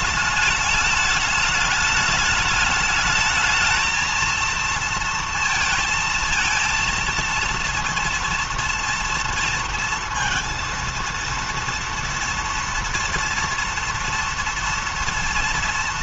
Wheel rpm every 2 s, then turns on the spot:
210, 210, 230, 230, 230, 230, 230, 230.
none